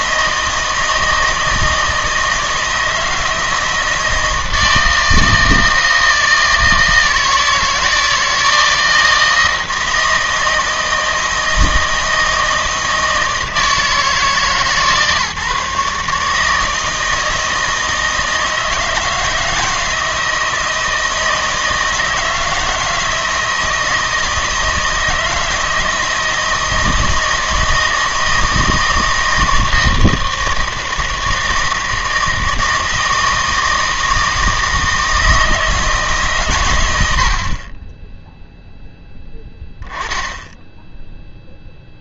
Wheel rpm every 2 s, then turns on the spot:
160, 160, 160, 160, 160, 160, 160, 140, 160, 160, 160, 160, 160, 160, 160, 160, 160, 160, 110, 0, 10.
none